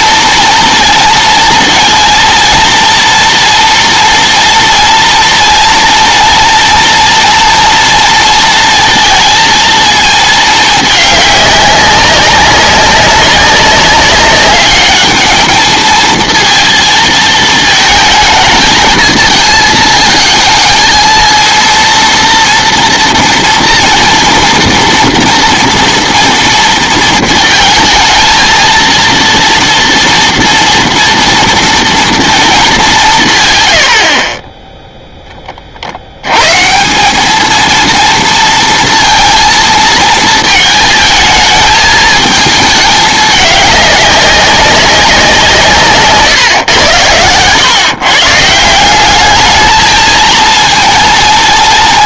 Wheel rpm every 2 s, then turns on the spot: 230, 230, 230, 230, 230, 210, 200, 210, 230, 220, 220, 230, 230, 230, 230, 230, 210, 20, 180, 230, 220, 210, 190, 110, 180, 230.
none